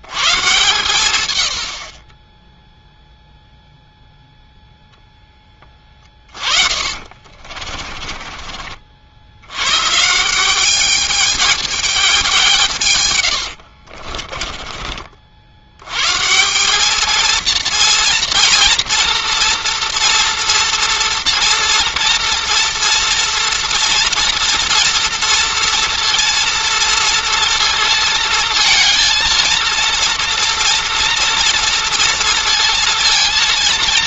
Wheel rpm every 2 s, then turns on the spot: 130, 0, 0, 40, 50, 210, 140, 30, 210, 230, 230, 230, 230, 230, 230, 230, 230.
6-8